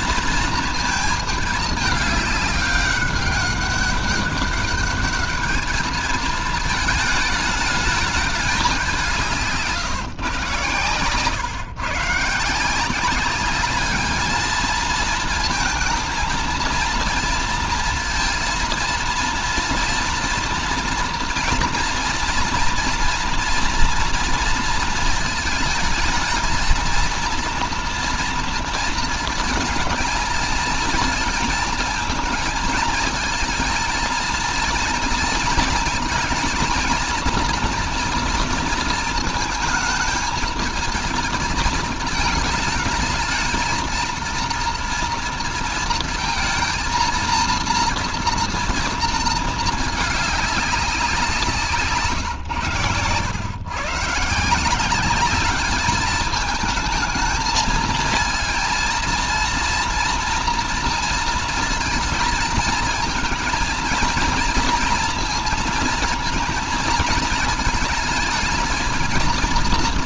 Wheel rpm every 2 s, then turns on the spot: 220, 200, 210, 220, 200, 130, 170, 220, 230, 230, 230, 230, 230, 220, 230, 220, 230, 230, 230, 230, 220, 210, 230, 230, 230, 190, 120, 180, 220, 230, 230, 220, 230, 230, 230.
none